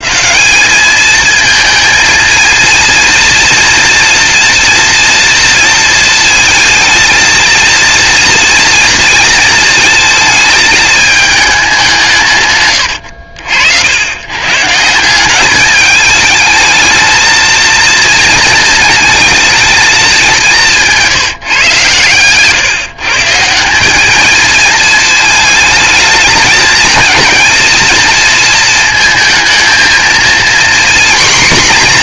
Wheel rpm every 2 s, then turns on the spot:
210, 230, 240, 230, 230, 220, 110, 140, 220, 230, 190, 140, 220, 220, 220, 240.
12-14